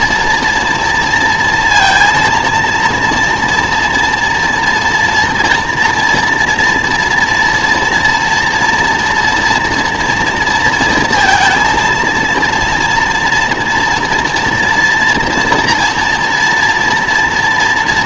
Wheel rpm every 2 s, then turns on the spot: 230, 230, 230, 230, 230, 240, 230, 240, 240.
none